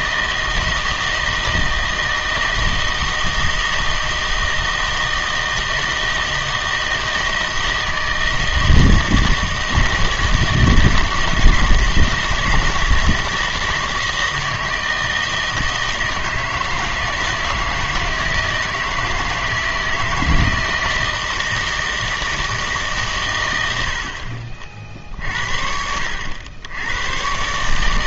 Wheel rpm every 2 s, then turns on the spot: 160, 160, 160, 160, 160, 160, 160, 160, 160, 160, 160, 150, 40, 90.
none